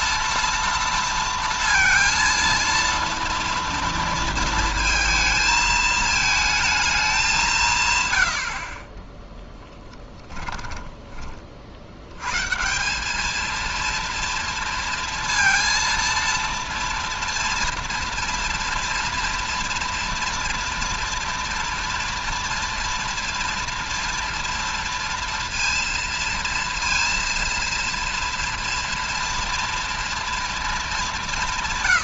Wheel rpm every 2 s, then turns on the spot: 230, 230, 220, 210, 20, 20, 200, 230, 240, 230, 230, 230, 230, 230, 230, 200.
8-10